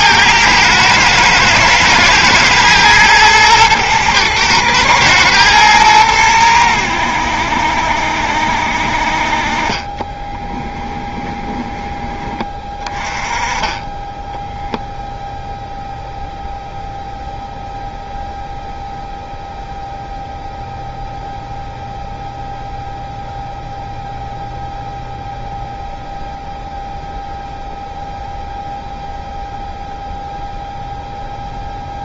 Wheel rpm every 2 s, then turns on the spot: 110, 120, 110, 90, 60, 20, 20, 0, 0, 0, 0, 0, 0, 0, 0, 0.
10-12